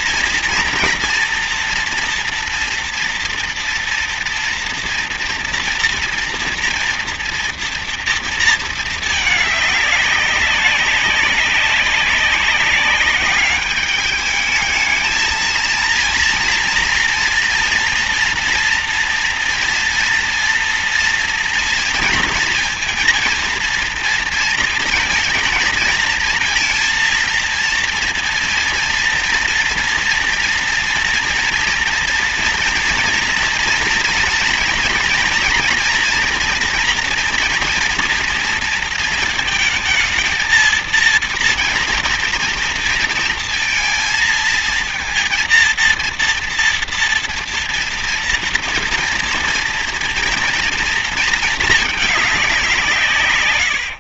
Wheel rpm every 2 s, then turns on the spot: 230, 230, 230, 230, 220, 200, 200, 210, 230, 230, 230, 230, 230, 230, 230, 230, 230, 230, 240, 230, 220, 230, 230, 230, 230, 230, 200.
none